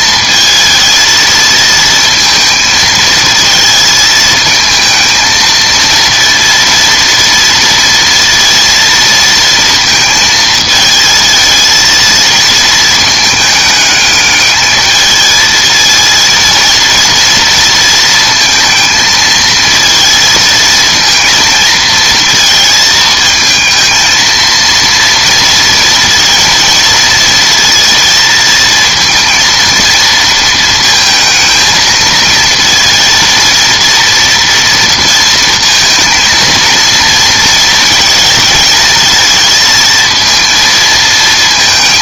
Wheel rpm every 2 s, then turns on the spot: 220, 220, 220, 230, 230, 220, 220, 220, 230, 220, 230, 220, 230, 230, 230, 230, 230, 230, 230, 220, 220.
none